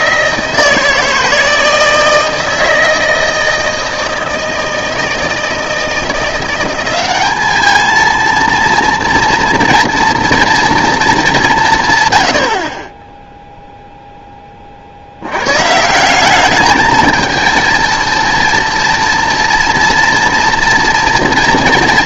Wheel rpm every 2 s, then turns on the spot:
160, 160, 160, 180, 230, 230, 50, 30, 210, 230, 240.
none